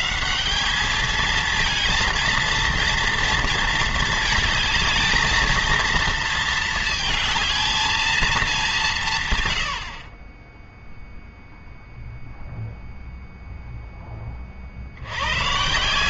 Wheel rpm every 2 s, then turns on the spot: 200, 230, 220, 220, 180, 0, 0, 60.
none